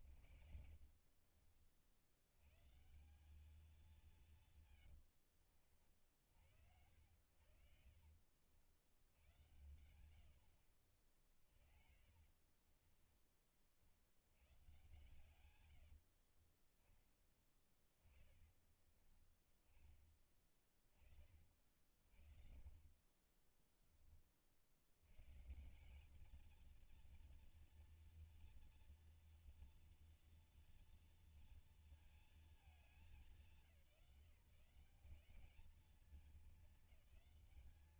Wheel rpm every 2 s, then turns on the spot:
50, 110, 160, 70, 60, 70, 40, 100, 40, 20, 30, 50, 40, 220, 230, 230, 230, 170, 210.
0-2 4-8 12-14 18-20 22-24